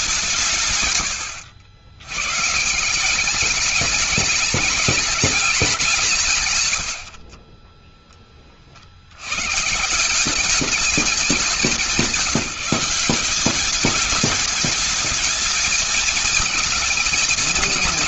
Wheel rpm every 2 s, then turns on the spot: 130, 150, 210, 130, 60, 200, 180, 220, 220.
none